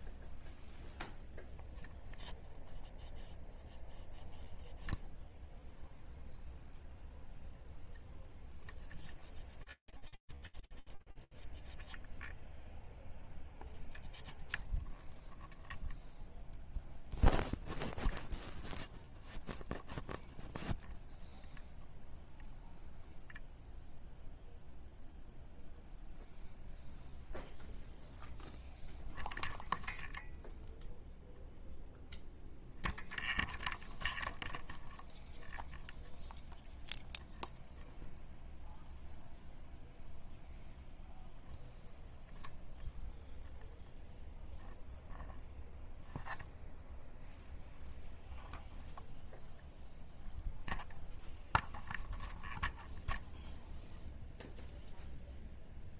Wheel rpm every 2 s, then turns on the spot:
0, 0, 0, 0, 0, 0, 0, 0, 0, 0, 0, 0, 0, 0, 0, 0, 0, 0, 0, 0, 0, 0, 0, 0, 0, 0, 0, 0.
none